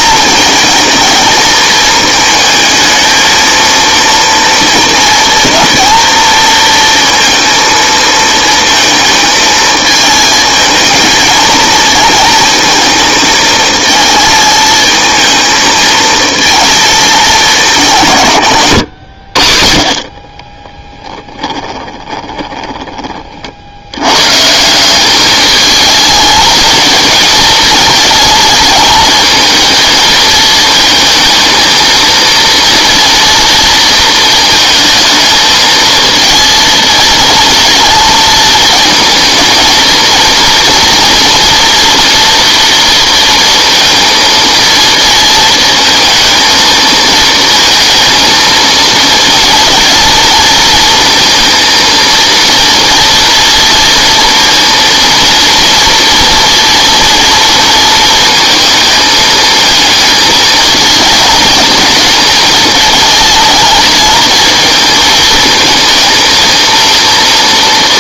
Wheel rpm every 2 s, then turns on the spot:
220, 220, 230, 230, 230, 220, 220, 220, 230, 100, 10, 20, 180, 220, 220, 220, 230, 230, 230, 220, 230, 230, 220, 230, 230, 230, 230, 230, 230, 220, 220, 220, 220, 230.
20-22